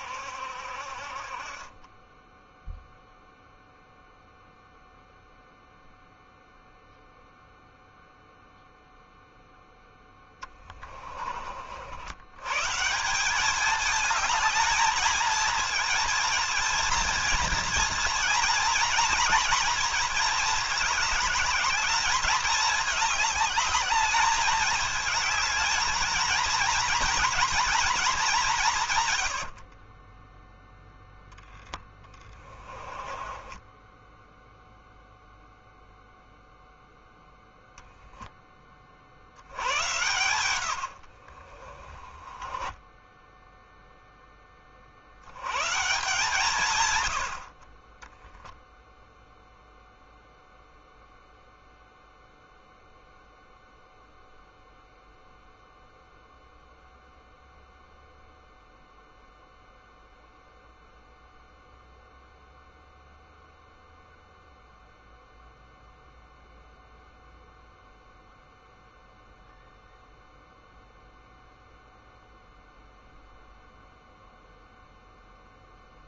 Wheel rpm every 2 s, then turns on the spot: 50, 0, 0, 0, 0, 20, 170, 220, 220, 230, 210, 220, 220, 240, 130, 10, 20, 0, 10, 50, 60, 0, 50, 120, 10, 0, 0, 0, 0, 0, 0, 0, 0, 0, 0, 0, 0, 0.
28-30 32-34 40-42